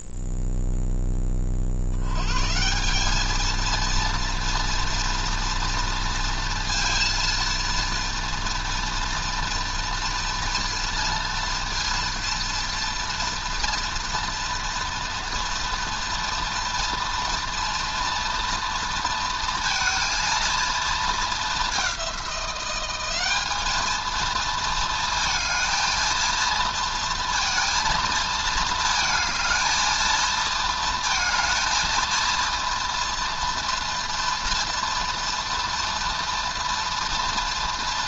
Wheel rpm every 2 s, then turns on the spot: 0, 160, 230, 230, 230, 230, 230, 230, 230, 230, 230, 190, 230, 230, 220, 230, 230, 230, 230.
none